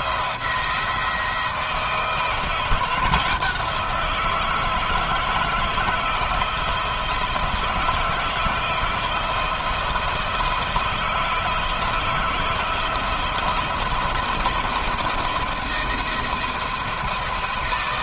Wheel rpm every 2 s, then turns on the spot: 170, 170, 170, 160, 160, 160, 160, 170, 170.
none